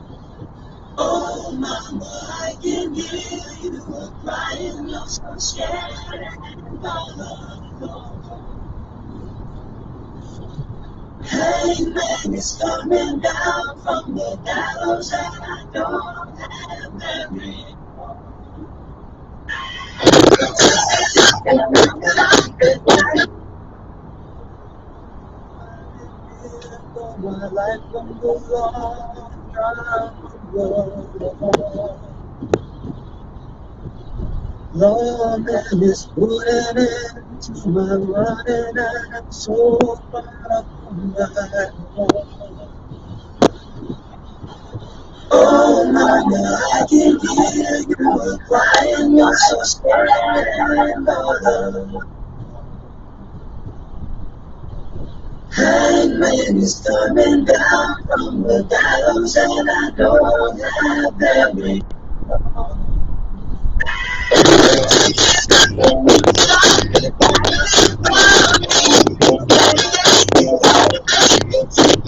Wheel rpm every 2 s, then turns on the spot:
0, 0, 0, 0, 0, 0, 0, 0, 0, 0, 0, 0, 0, 0, 0, 0, 0, 0, 0, 0, 0, 0, 0, 0, 0, 0, 0, 0, 0, 0, 0, 0, 0, 0, 0, 0.
none